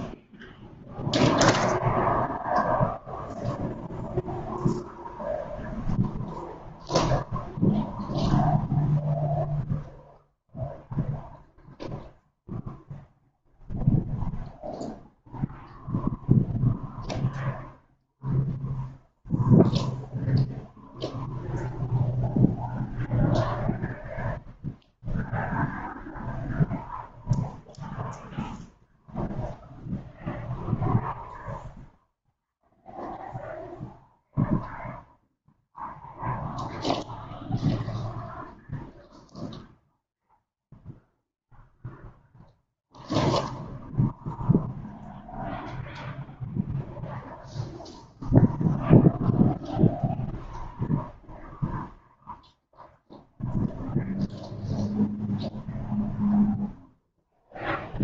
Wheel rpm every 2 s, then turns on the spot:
0, 0, 0, 0, 0, 0, 0, 0, 0, 0, 0, 0, 0, 0, 0, 0, 0, 0, 0, 0, 0, 0, 0, 0, 0, 0, 0, 0, 0.
none